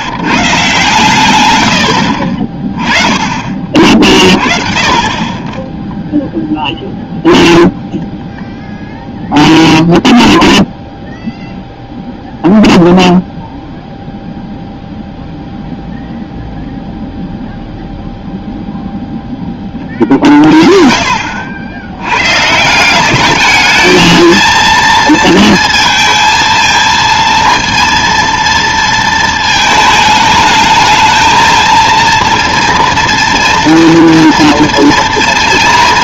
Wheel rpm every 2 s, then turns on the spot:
130, 30, 40, 0, 0, 0, 0, 0, 0, 0, 40, 150, 230, 220, 230, 220, 230, 230.
none